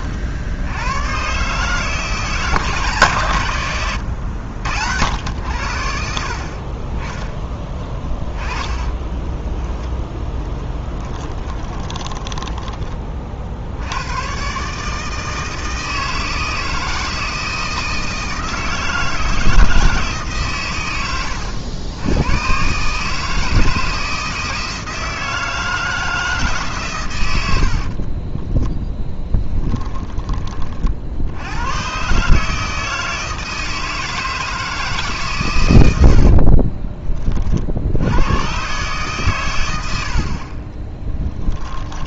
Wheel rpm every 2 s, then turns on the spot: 110, 140, 80, 30, 10, 10, 30, 150, 160, 160, 110, 140, 160, 130, 10, 50, 160, 150, 30, 130, 20.
8-12 28-30 36-38 40-42